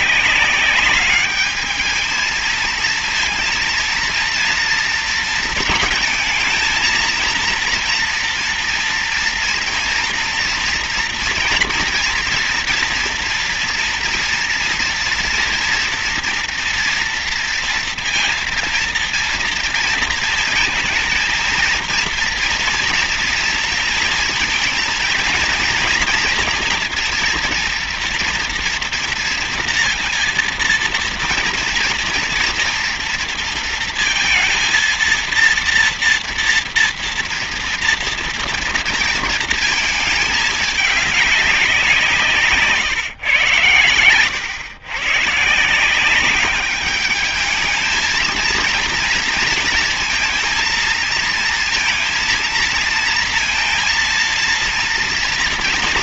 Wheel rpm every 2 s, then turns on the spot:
190, 220, 230, 230, 230, 230, 230, 230, 230, 230, 230, 230, 220, 240, 230, 230, 230, 230, 230, 230, 210, 150, 110, 200, 230, 230, 230, 230.
none